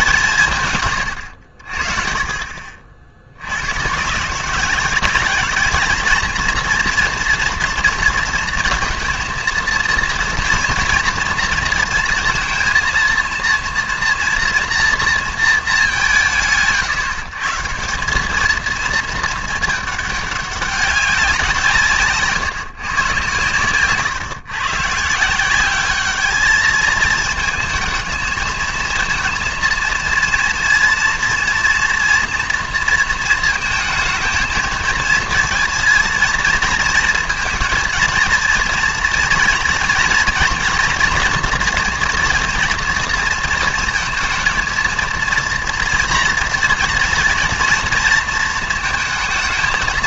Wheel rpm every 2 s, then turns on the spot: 150, 50, 170, 230, 230, 230, 230, 240, 160, 210, 200, 140, 130, 220, 220, 230, 230, 230, 230, 230, 240, 240, 230, 240, 230.
none